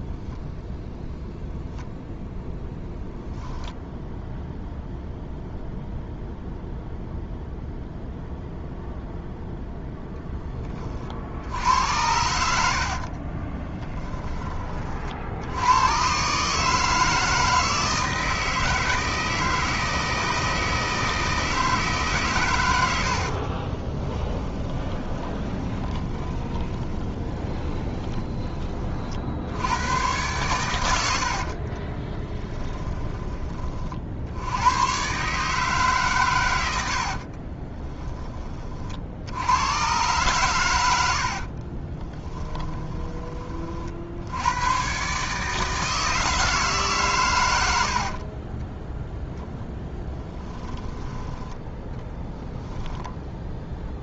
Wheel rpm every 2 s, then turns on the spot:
0, 0, 0, 0, 0, 40, 60, 60, 160, 160, 160, 80, 10, 20, 40, 90, 10, 120, 70, 50, 90, 20, 120, 140, 10, 10, 10.
12-14 22-28 36-38 40-44